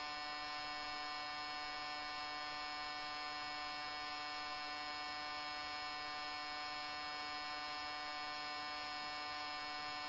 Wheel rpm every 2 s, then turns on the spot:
0, 0, 0, 0, 0.
none